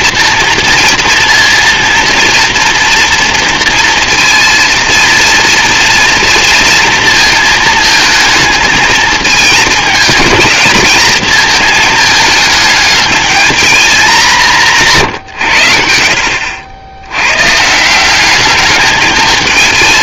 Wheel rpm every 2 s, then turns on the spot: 230, 230, 230, 230, 220, 210, 210, 170, 80, 210.
none